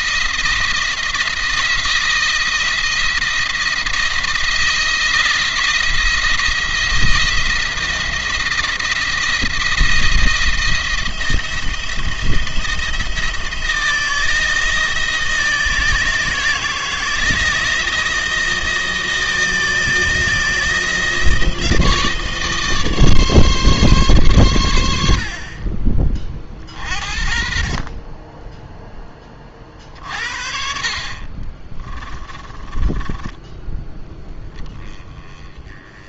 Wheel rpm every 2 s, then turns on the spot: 170, 170, 170, 170, 170, 170, 160, 160, 170, 160, 160, 150, 90, 40, 10, 50, 20, 10.
32-34